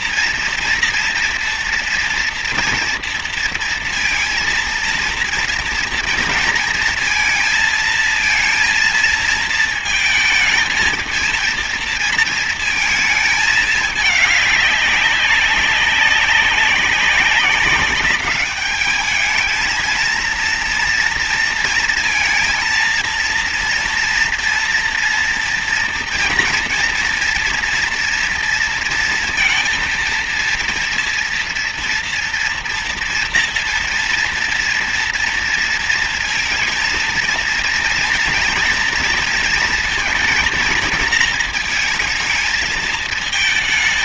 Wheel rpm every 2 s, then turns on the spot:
230, 230, 230, 230, 230, 220, 230, 210, 190, 200, 230, 230, 230, 230, 230, 230, 230, 230, 230, 240, 230, 220.
none